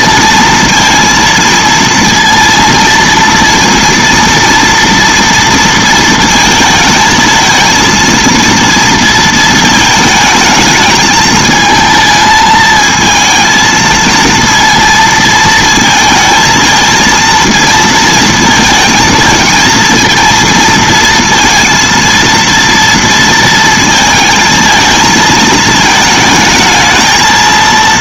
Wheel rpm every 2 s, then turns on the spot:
230, 230, 230, 230, 230, 220, 220, 230, 230, 230, 230, 230, 220, 220.
none